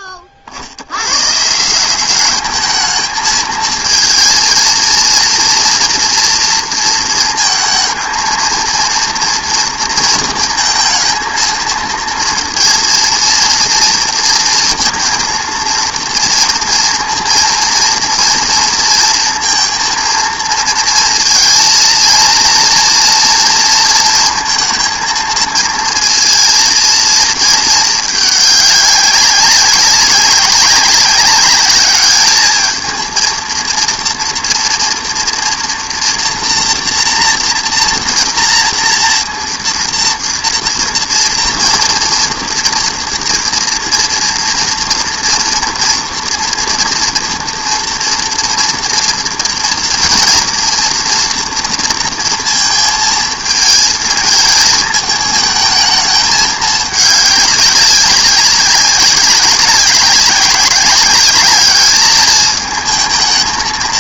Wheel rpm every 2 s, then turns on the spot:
60, 210, 230, 230, 230, 220, 230, 230, 230, 230, 230, 230, 230, 230, 200, 200, 220, 230, 230, 230, 230, 230, 230, 240, 230, 230, 230, 220, 210, 200, 200, 220.
none